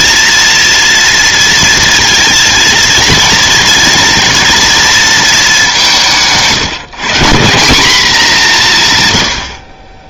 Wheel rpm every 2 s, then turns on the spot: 230, 230, 230, 160, 180.
none